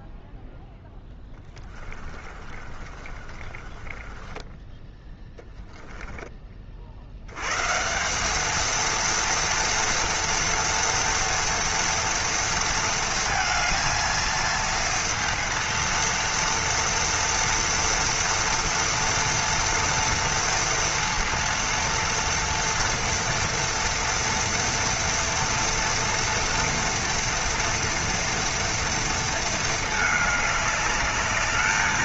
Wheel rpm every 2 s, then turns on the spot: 10, 30, 10, 60, 230, 230, 230, 230, 230, 230, 230, 230, 230, 230, 230, 210.
0-4